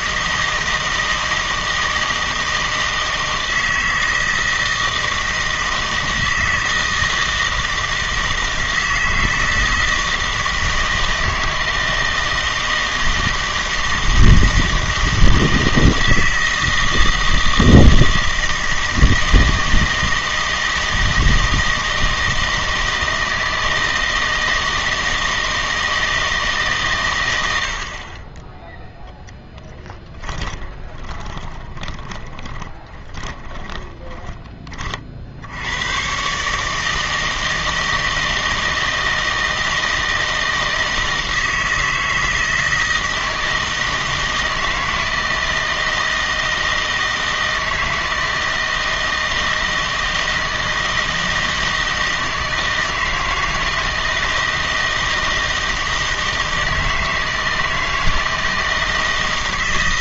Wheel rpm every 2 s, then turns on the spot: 160, 160, 160, 160, 160, 160, 160, 160, 160, 160, 160, 160, 160, 150, 20, 20, 20, 30, 150, 160, 160, 160, 160, 160, 160, 160, 160, 160, 160, 160.
30-34